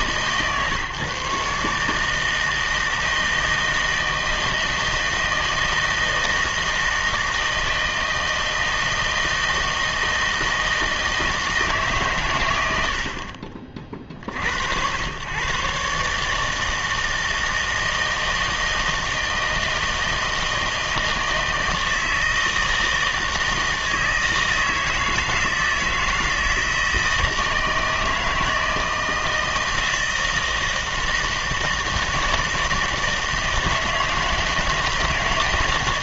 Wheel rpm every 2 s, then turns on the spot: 150, 160, 160, 160, 160, 160, 100, 70, 160, 160, 160, 160, 160, 160, 160, 160, 160, 160.
none